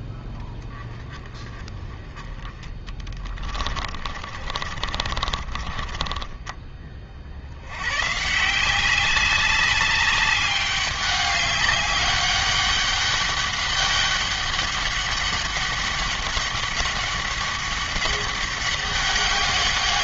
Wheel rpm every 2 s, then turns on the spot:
10, 30, 30, 20, 170, 200, 200, 200, 200, 200.
2-6